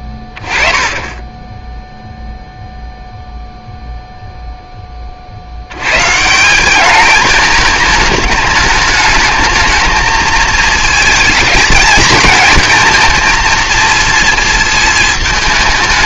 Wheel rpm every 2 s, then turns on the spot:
10, 0, 10, 200, 210, 220, 220, 220.
none